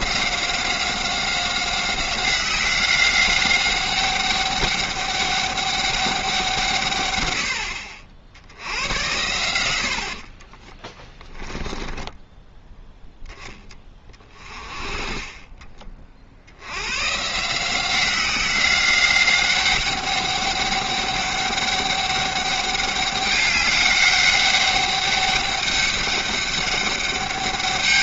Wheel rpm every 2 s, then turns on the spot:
190, 190, 200, 150, 80, 30, 10, 30, 80, 190, 200, 200, 200, 200.
10-12